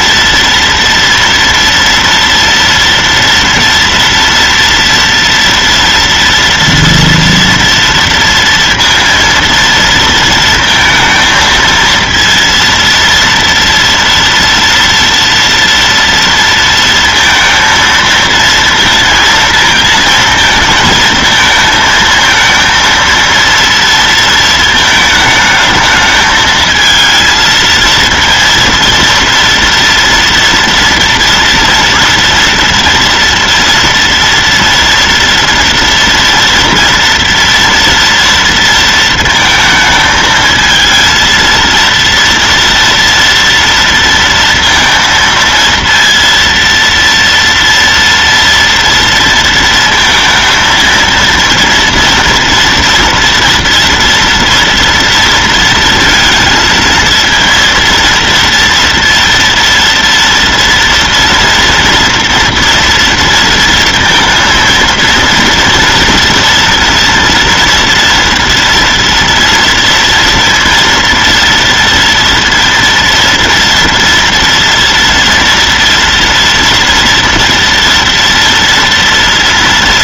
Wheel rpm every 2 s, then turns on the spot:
230, 230, 230, 230, 230, 230, 230, 230, 230, 230, 220, 220, 230, 220, 230, 230, 230, 230, 230, 230, 220, 230, 230, 230, 230, 230, 230, 240, 230, 230, 240, 230, 230, 230, 230, 230, 230, 240, 230, 230.
none